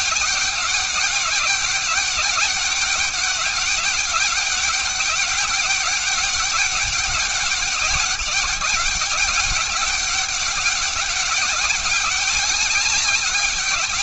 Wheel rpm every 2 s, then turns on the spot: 200, 200, 200, 200, 200, 190, 200.
none